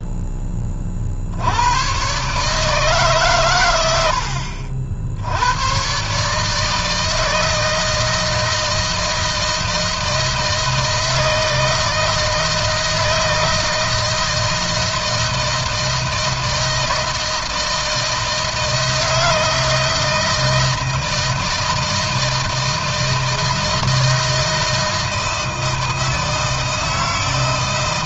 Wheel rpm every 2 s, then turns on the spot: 50, 140, 70, 160, 160, 160, 160, 160, 160, 160, 160, 160, 160, 160.
none